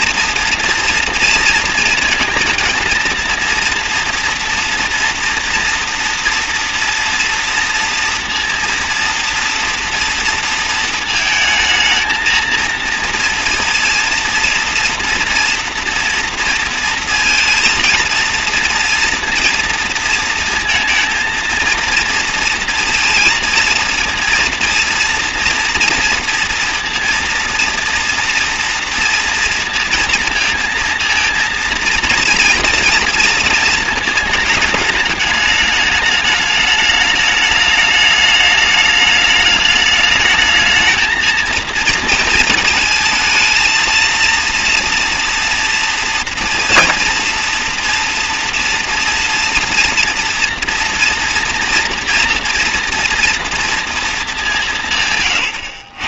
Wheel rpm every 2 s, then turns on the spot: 230, 230, 230, 240, 230, 230, 230, 240, 230, 230, 230, 230, 230, 230, 230, 230, 230, 210, 210, 210, 220, 220, 230, 230, 230, 230, 230, 160.
none